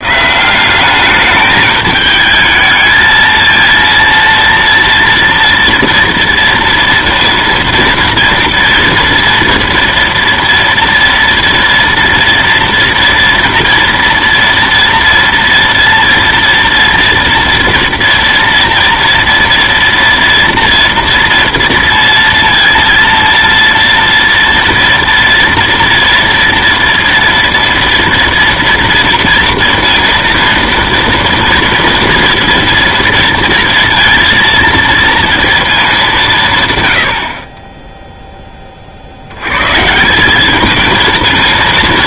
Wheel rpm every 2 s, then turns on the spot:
180, 220, 230, 230, 240, 230, 230, 230, 230, 240, 230, 230, 230, 230, 230, 230, 230, 230, 140, 20, 210.
none